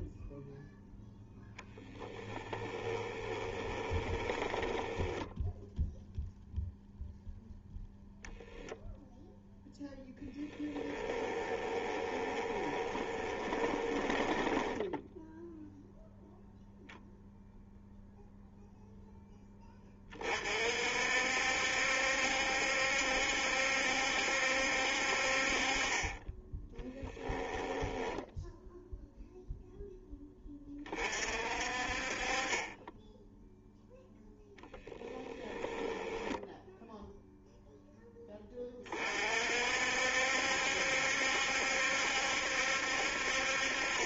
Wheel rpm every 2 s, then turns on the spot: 0, 10, 10, 0, 0, 20, 20, 10, 0, 0, 60, 70, 60, 10, 0, 30, 10, 10, 0, 30, 70, 60.
2-6 10-16